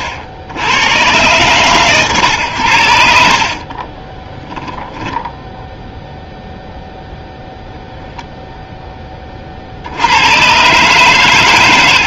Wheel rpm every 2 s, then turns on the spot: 40, 80, 10, 0, 10, 120.
none